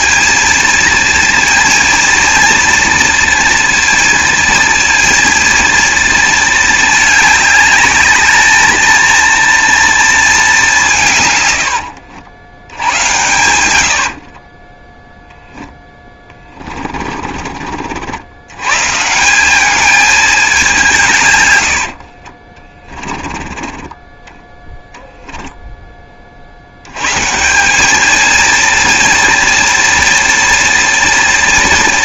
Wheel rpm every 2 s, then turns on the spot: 230, 230, 230, 210, 210, 190, 90, 10, 30, 130, 190, 30, 10, 70, 230, 240.
14-18 22-24